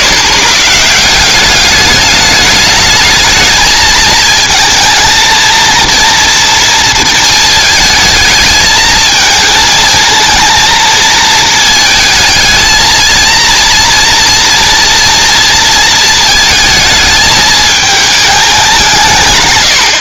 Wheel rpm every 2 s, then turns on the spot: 110, 210, 220, 230, 220, 230, 220, 230, 220, 200.
none